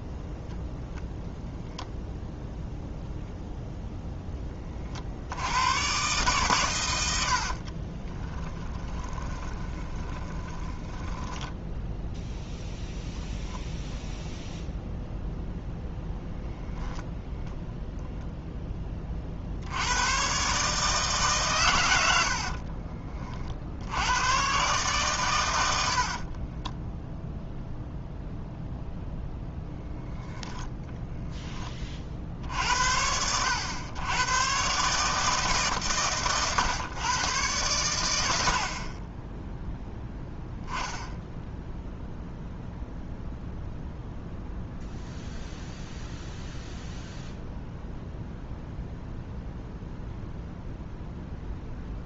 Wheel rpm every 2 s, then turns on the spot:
0, 0, 40, 90, 20, 10, 0, 0, 10, 20, 150, 40, 130, 0, 10, 10, 60, 140, 120, 40, 0, 0, 0, 0, 0, 0.
8-12 16-18